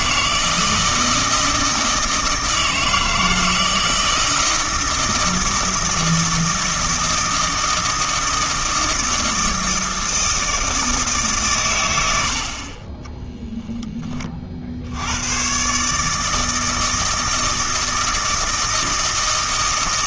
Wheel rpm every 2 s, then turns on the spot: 160, 160, 160, 160, 160, 160, 30, 70, 160, 160.
none